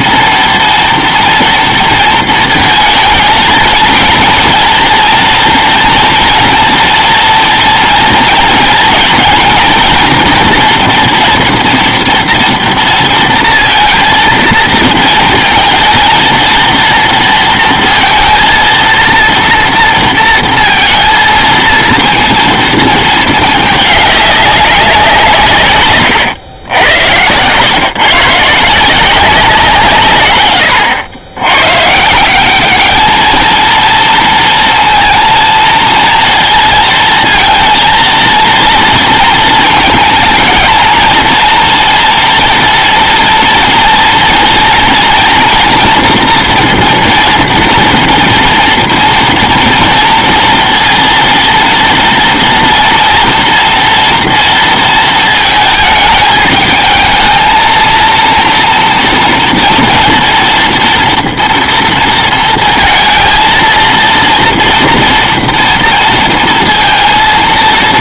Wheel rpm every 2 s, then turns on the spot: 240, 230, 230, 230, 230, 230, 230, 230, 230, 230, 230, 230, 200, 100, 150, 120, 200, 230, 230, 230, 230, 230, 230, 230, 230, 230, 230, 230, 210, 230, 230, 230, 230, 230.
none